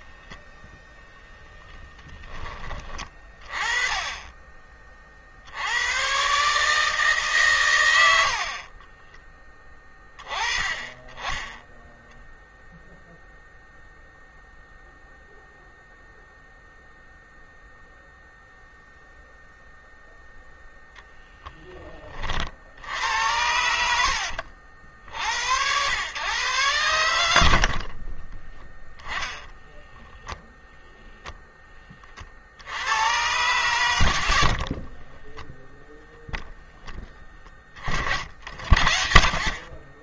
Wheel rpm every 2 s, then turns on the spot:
0, 30, 40, 150, 30, 10, 0, 0, 0, 0, 0, 70, 70, 100, 10, 0, 90, 30, 10, 40.
8-10 34-36